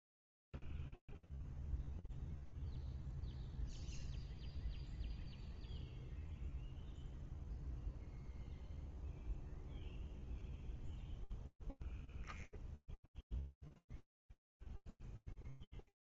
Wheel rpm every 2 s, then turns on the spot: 0, 0, 0, 0, 0, 0, 0, 0.
none